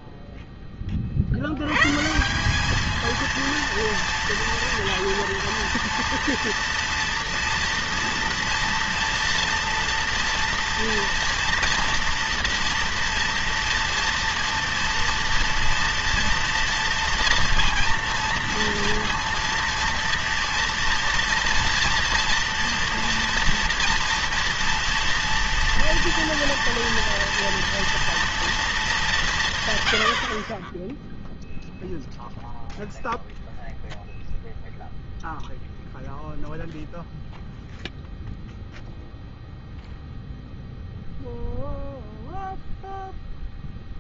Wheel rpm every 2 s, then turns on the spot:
20, 200, 230, 230, 230, 230, 230, 230, 230, 230, 230, 230, 230, 230, 210, 20, 0, 0, 0, 0, 0, 0.
none